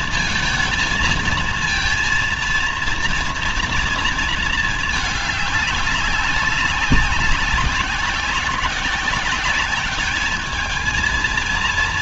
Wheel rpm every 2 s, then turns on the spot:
230, 230, 220, 190, 190, 220.
none